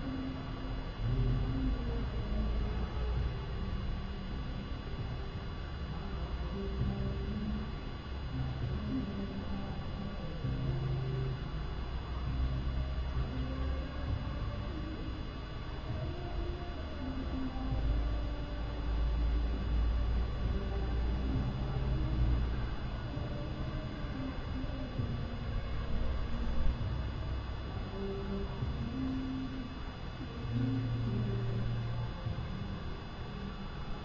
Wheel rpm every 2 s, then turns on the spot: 0, 0, 0, 0, 0, 0, 0, 0, 0, 0, 0, 0, 0, 0, 0, 0, 0.
none